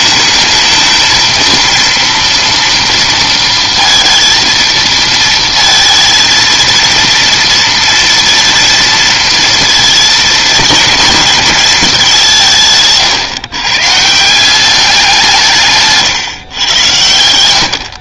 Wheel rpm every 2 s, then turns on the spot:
220, 230, 230, 230, 230, 220, 170, 180, 120.
none